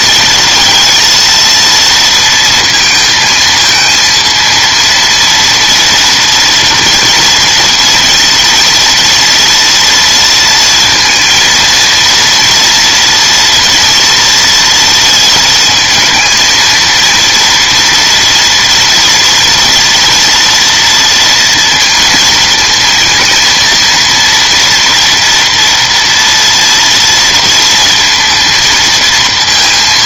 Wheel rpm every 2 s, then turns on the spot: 230, 220, 230, 230, 230, 230, 230, 230, 230, 230, 230, 230, 230, 230, 230.
none